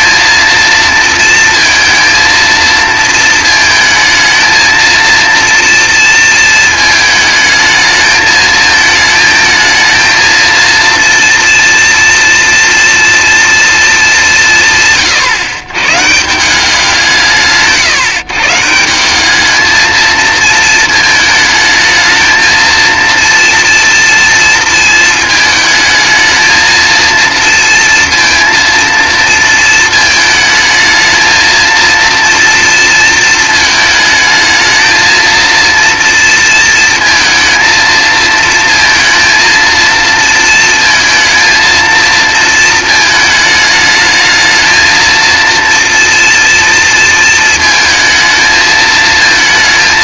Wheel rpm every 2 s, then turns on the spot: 230, 230, 230, 220, 220, 230, 230, 160, 180, 170, 220, 230, 220, 230, 230, 220, 230, 220, 230, 230, 230, 230, 220, 230, 220.
none